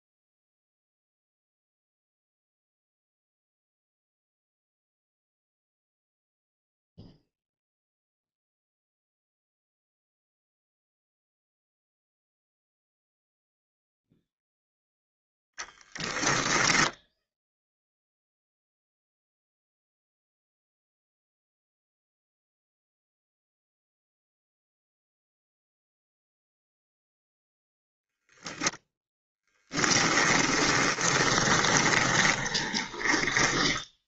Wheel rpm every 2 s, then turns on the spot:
0, 0, 0, 0, 0, 0, 0, 0, 0, 0, 0, 0, 0, 0, 10, 10, 20.
30-34